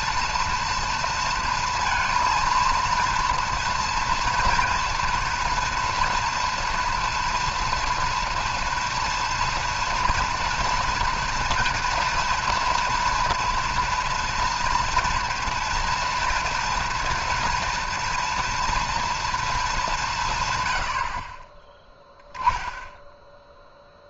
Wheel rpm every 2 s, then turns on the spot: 230, 230, 240, 230, 230, 230, 230, 240, 240, 240, 110, 20.
none